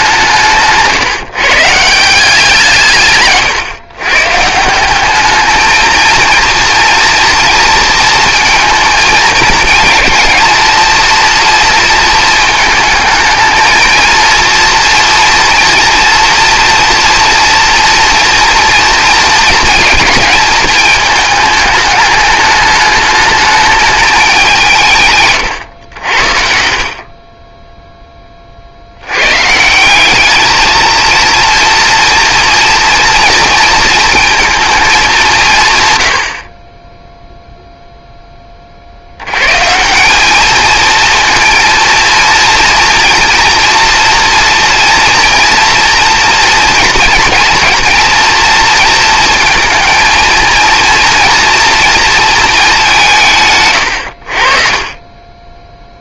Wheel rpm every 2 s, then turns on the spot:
160, 160, 180, 230, 220, 230, 220, 230, 230, 230, 220, 210, 170, 50, 80, 220, 230, 210, 20, 40, 220, 230, 240, 230, 230, 230, 190, 40.
0-2 54-56